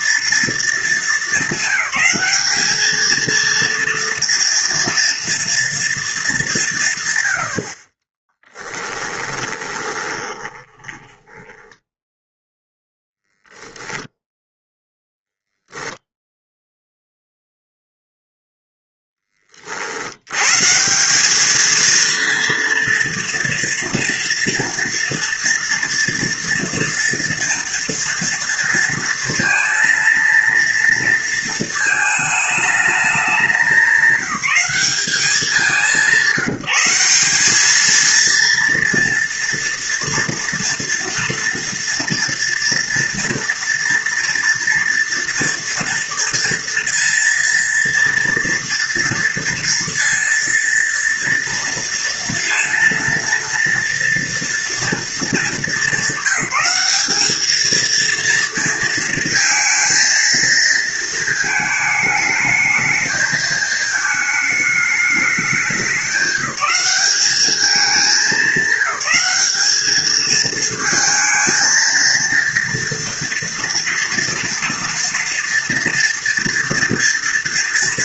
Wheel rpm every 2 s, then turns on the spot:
230, 220, 230, 150, 10, 10, 0, 0, 0, 0, 160, 230, 230, 230, 230, 230, 210, 200, 180, 230, 230, 230, 230, 230, 230, 230, 230, 230, 200, 230, 230, 220, 210, 190, 200, 220, 230, 230, 230.
8-12